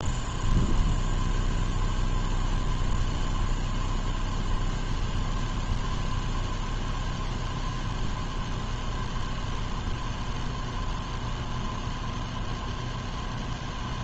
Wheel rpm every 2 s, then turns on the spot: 0, 0, 0, 0, 0, 0, 0.
none